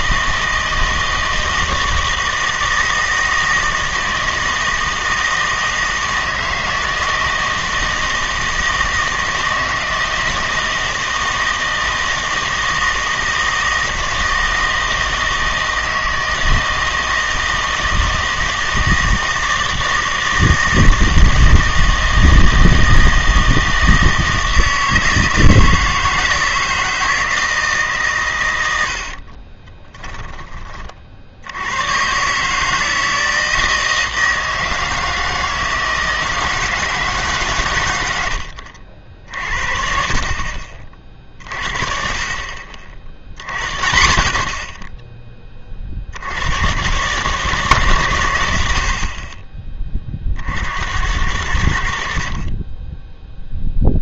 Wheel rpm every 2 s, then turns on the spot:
160, 160, 160, 160, 160, 160, 160, 160, 160, 160, 160, 160, 160, 160, 100, 20, 150, 160, 160, 70, 40, 50, 30, 110, 70, 70, 20.
none